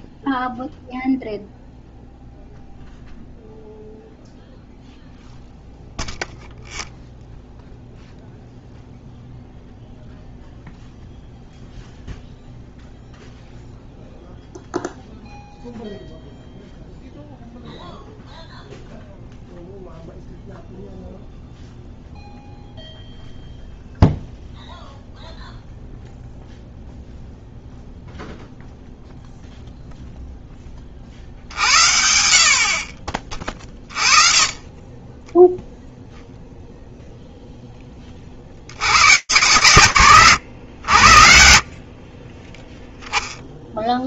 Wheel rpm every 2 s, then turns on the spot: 0, 0, 0, 0, 0, 0, 0, 0, 0, 0, 0, 0, 0, 0, 0, 30, 40, 20, 0, 120, 70, 0.
none